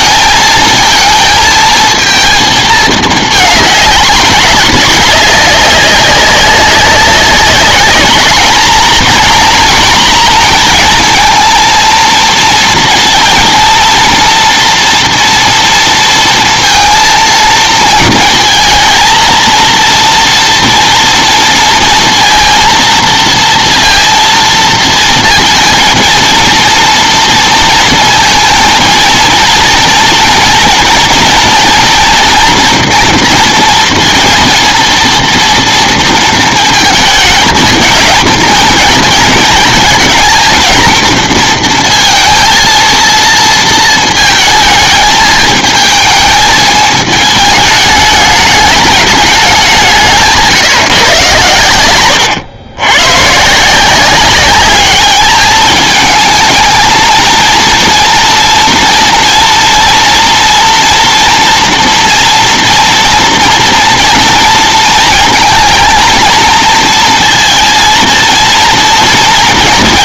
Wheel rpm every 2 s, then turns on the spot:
230, 220, 210, 190, 230, 230, 230, 230, 230, 220, 230, 230, 230, 230, 220, 230, 230, 230, 230, 230, 230, 230, 220, 220, 210, 150, 110, 200, 220, 230, 230, 240, 230, 230, 230.
none